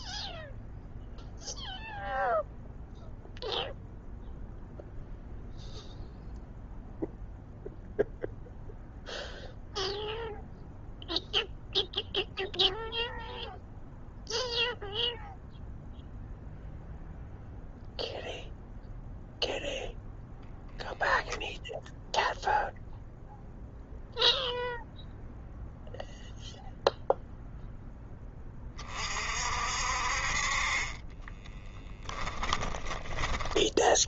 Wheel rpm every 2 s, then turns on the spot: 0, 0, 0, 0, 0, 0, 0, 0, 0, 0, 0, 0, 0, 0, 40, 40, 10.
30-34